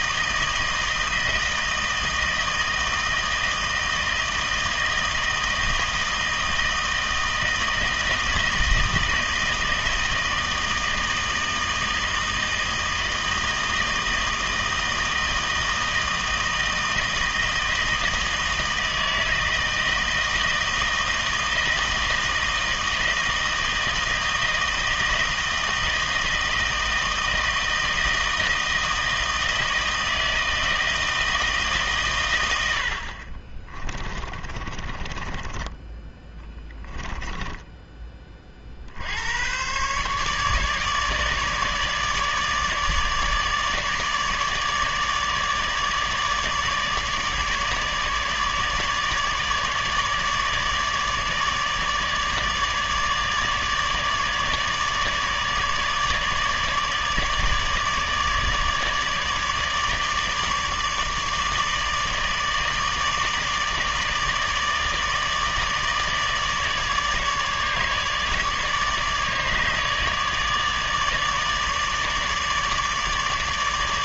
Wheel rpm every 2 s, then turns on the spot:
160, 160, 160, 160, 160, 160, 160, 160, 160, 160, 160, 160, 160, 160, 160, 160, 70, 30, 10, 50, 150, 150, 150, 150, 150, 150, 150, 150, 150, 150, 150, 150, 160, 150, 150, 150, 150.
34-38